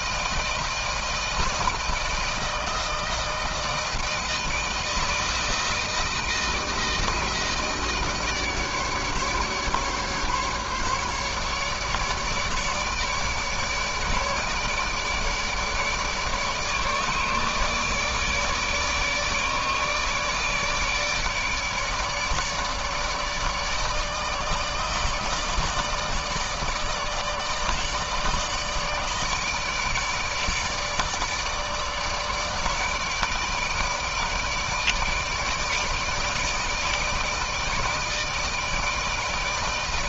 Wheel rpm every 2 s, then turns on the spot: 160, 160, 160, 160, 150, 150, 150, 150, 150, 150, 150, 150, 160, 150, 160, 150, 160, 160, 160, 160.
none